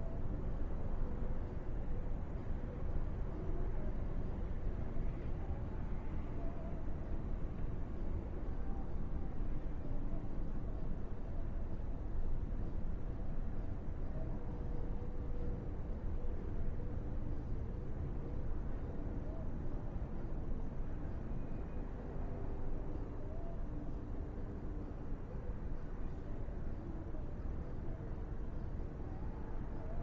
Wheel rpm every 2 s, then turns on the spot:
0, 0, 0, 0, 0, 0, 0, 0, 0, 0, 0, 0, 0, 0, 0.
none